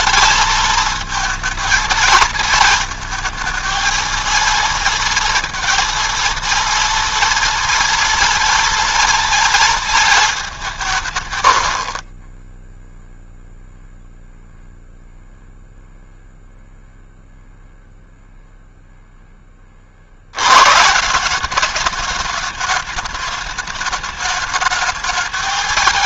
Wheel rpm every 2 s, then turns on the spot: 230, 220, 230, 230, 230, 170, 0, 0, 0, 0, 120, 210, 210.
none